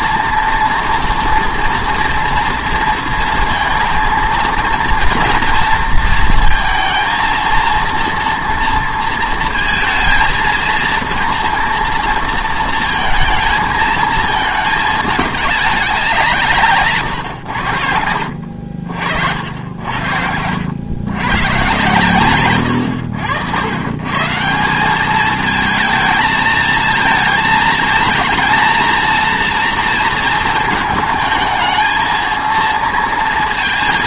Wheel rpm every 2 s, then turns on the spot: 230, 230, 230, 230, 230, 230, 230, 210, 150, 60, 100, 110, 180, 220, 230, 230, 230.
none